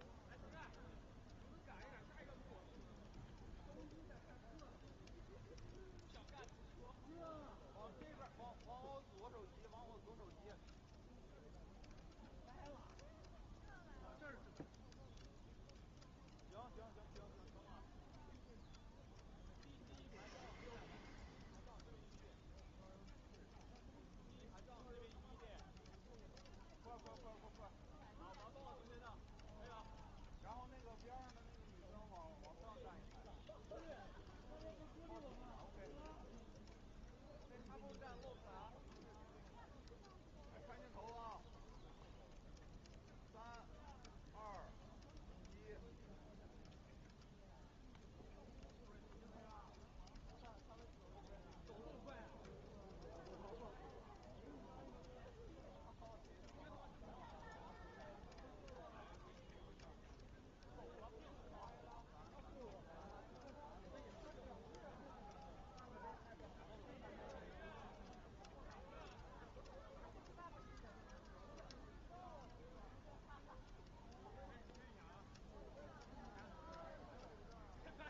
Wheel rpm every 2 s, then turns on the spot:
0, 0, 0, 0, 0, 0, 0, 0, 0, 0, 0, 0, 0, 0, 0, 0, 0, 0, 0, 0, 0, 0, 0, 0, 0, 0, 0, 0, 0, 0, 0, 0, 0, 0, 0, 0, 0, 0, 0.
none